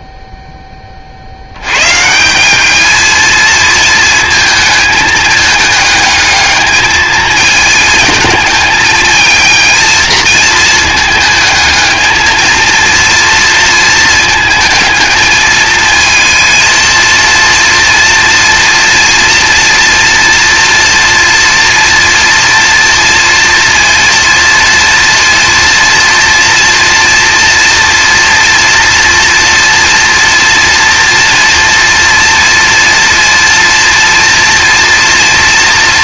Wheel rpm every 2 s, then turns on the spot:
10, 190, 220, 210, 220, 230, 230, 220, 230, 230, 230, 230, 230, 240, 240, 230, 230, 230.
none